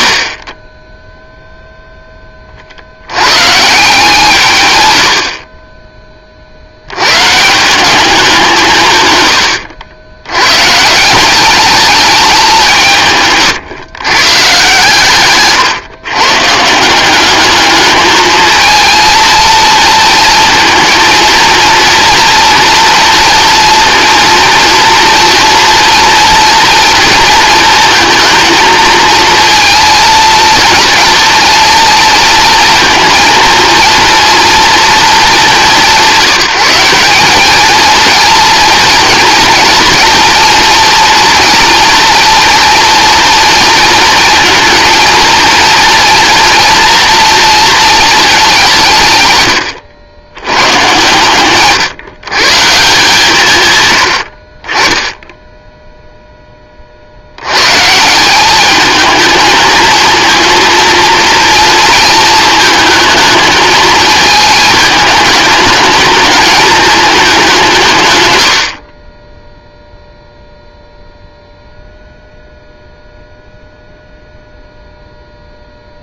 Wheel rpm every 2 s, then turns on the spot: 60, 50, 120, 80, 160, 140, 170, 140, 160, 230, 230, 230, 230, 230, 230, 230, 230, 240, 180, 230, 230, 230, 230, 230, 180, 110, 150, 40, 30, 210, 230, 230, 210, 210, 70, 0, 0, 0.
none